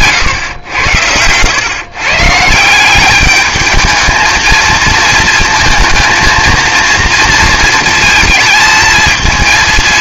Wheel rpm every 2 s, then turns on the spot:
110, 170, 220, 230, 220.
none